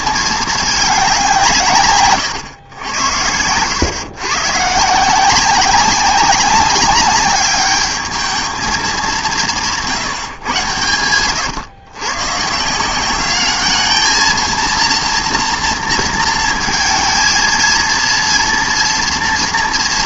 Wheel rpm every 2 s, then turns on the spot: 220, 120, 140, 190, 220, 130, 140, 230, 230, 230.
none